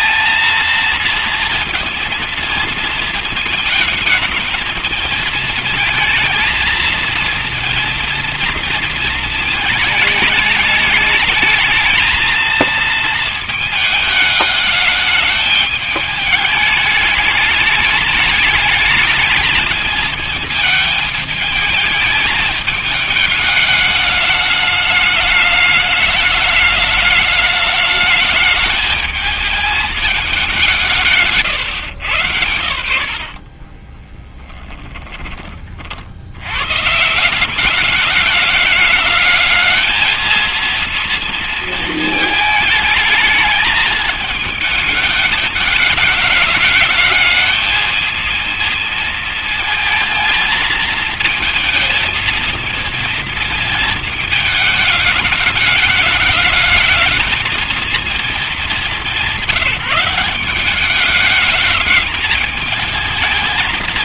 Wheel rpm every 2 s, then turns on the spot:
230, 230, 220, 220, 230, 210, 230, 210, 210, 210, 220, 220, 210, 210, 220, 180, 80, 10, 110, 210, 230, 220, 220, 210, 230, 230, 230, 210, 210, 200, 190, 220.
34-36